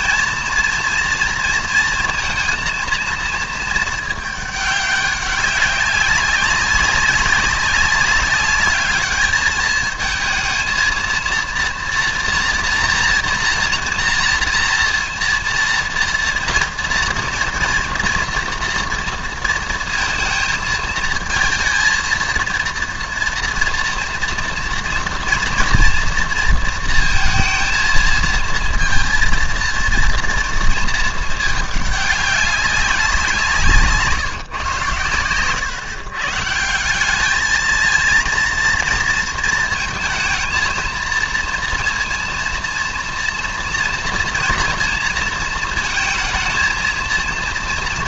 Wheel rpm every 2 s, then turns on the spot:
230, 230, 210, 200, 210, 220, 230, 230, 230, 230, 220, 230, 230, 230, 230, 230, 200, 130, 160, 230, 220, 230, 230, 230.
none